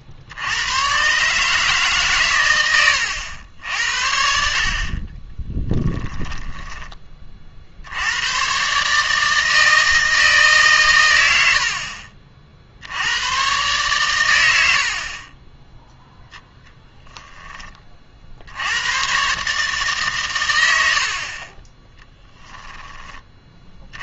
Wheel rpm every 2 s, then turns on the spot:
110, 100, 50, 20, 140, 120, 70, 60, 0, 90, 90, 10.
none